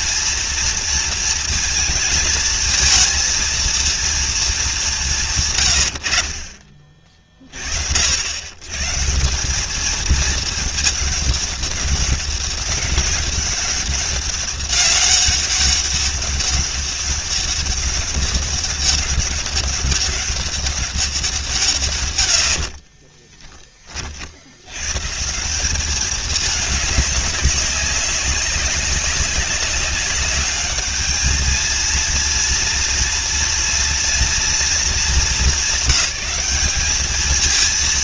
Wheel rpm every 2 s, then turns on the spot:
230, 220, 200, 40, 110, 210, 200, 200, 200, 200, 200, 40, 100, 210, 200, 210, 230, 220, 190.
22-24